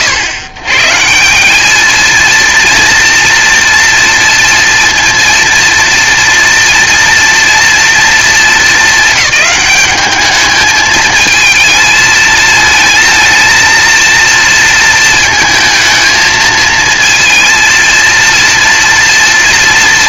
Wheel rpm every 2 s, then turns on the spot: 120, 230, 240, 230, 210, 220, 230, 230, 230, 230.
none